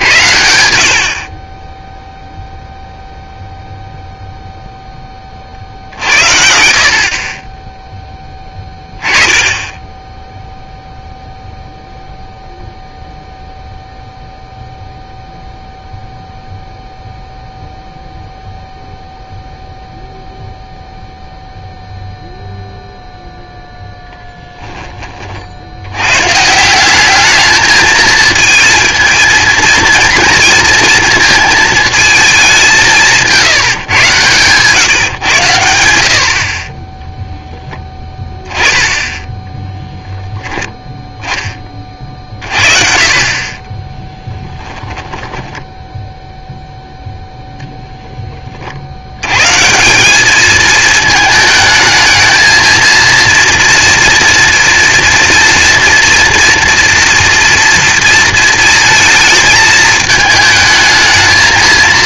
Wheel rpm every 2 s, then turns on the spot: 40, 0, 30, 40, 10, 0, 0, 0, 0, 0, 0, 0, 30, 200, 220, 220, 160, 120, 0, 10, 10, 40, 10, 0, 80, 220, 230, 230, 230, 220, 220.
44-46